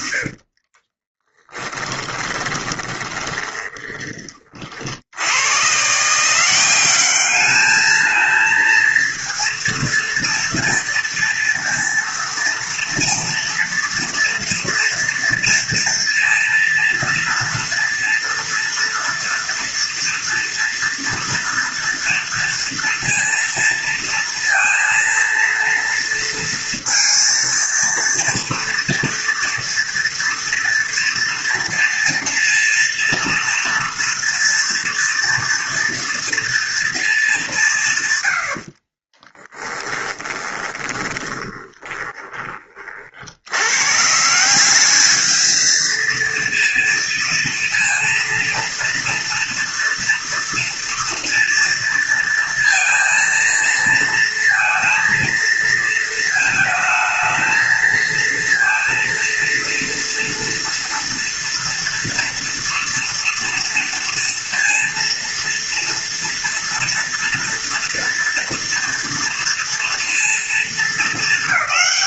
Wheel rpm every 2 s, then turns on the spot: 50, 20, 40, 190, 230, 230, 230, 230, 230, 230, 240, 230, 230, 230, 230, 230, 230, 230, 230, 60, 20, 40, 200, 230, 230, 230, 230, 230, 220, 230, 230, 230, 230, 230, 230, 210.
0-4 38-42